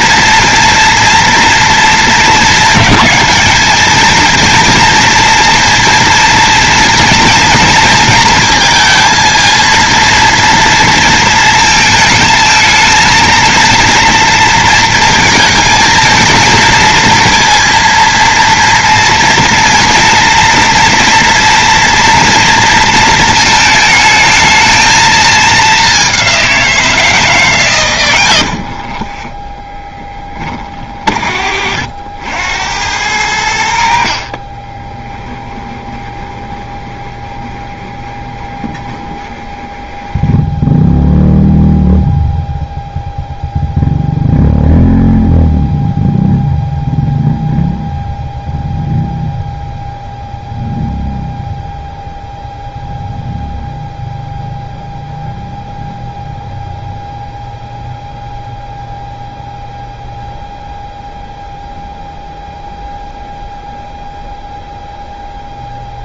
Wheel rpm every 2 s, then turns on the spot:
230, 210, 230, 230, 230, 230, 220, 230, 230, 230, 230, 230, 220, 180, 70, 30, 90, 30, 20, 20, 0, 0, 0, 0, 0, 0, 0, 0, 0, 0, 0, 0, 0.
28-30 34-40